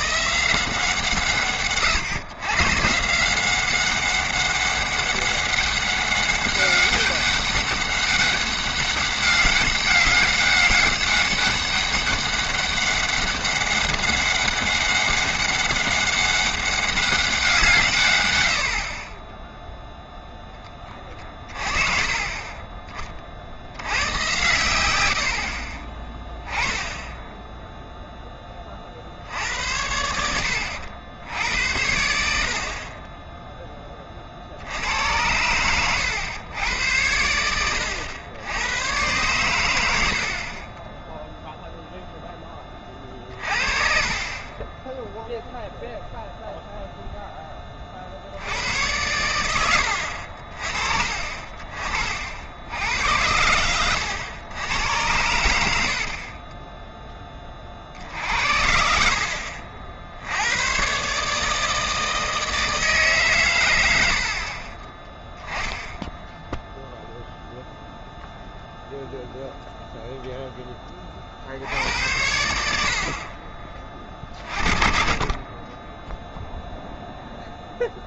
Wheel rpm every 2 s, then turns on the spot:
160, 130, 200, 200, 200, 190, 200, 200, 200, 80, 30, 20, 100, 10, 30, 80, 60, 60, 100, 100, 30, 20, 20, 0, 90, 40, 80, 100, 10, 60, 100, 160, 40, 0, 0, 10, 80, 50, 0.
56-58 72-74